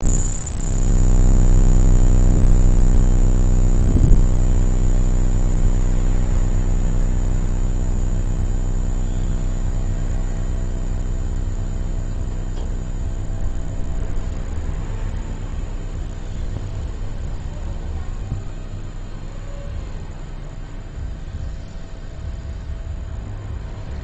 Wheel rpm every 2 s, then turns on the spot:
0, 0, 0, 0, 0, 0, 0, 0, 0, 0, 0, 0.
none